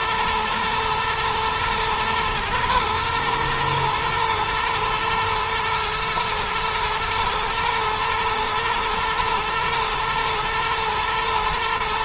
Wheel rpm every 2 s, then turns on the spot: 120, 120, 110, 110, 120, 110.
none